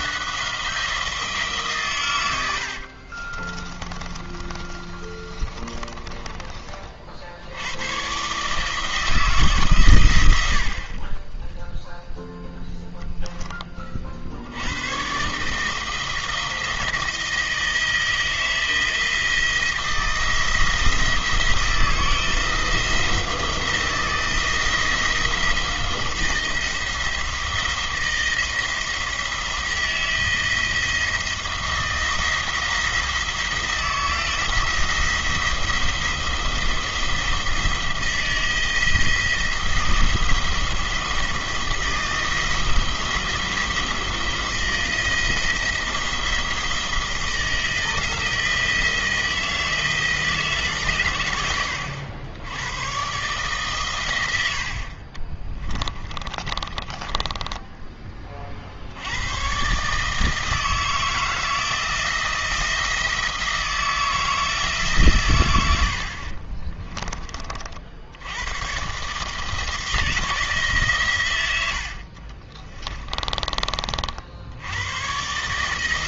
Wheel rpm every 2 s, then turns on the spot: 170, 70, 30, 30, 150, 60, 0, 80, 170, 170, 160, 160, 160, 170, 170, 170, 170, 170, 170, 170, 170, 170, 170, 170, 170, 140, 100, 70, 30, 60, 160, 170, 150, 30, 120, 150, 30, 80.
2-6 56-58 66-68 72-74